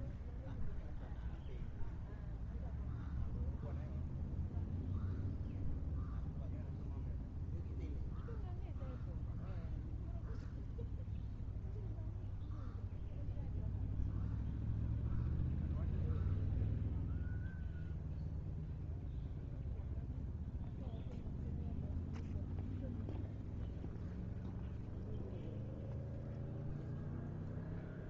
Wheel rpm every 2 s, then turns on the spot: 0, 0, 0, 0, 0, 0, 0, 0, 0, 0, 0, 0, 0, 0.
none